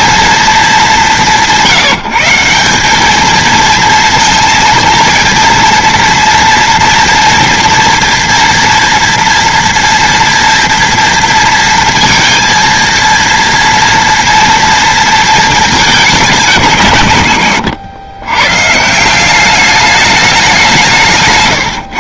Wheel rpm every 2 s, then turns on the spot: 210, 200, 230, 240, 230, 230, 230, 230, 160, 150, 180.
none